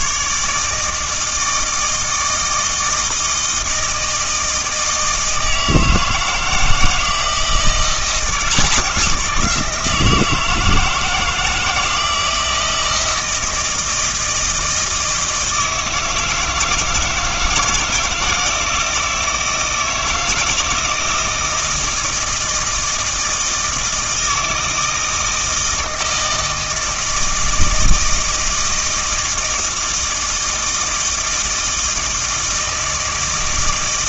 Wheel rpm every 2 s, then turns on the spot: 150, 160, 160, 160, 180, 160, 160, 160, 160, 170, 160, 160, 160, 160, 160, 160, 160.
none